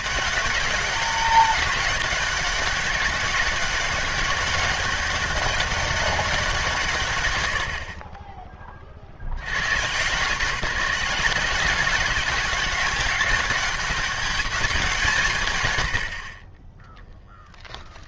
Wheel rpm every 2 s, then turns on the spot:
200, 190, 190, 170, 10, 170, 190, 190, 20.
16-18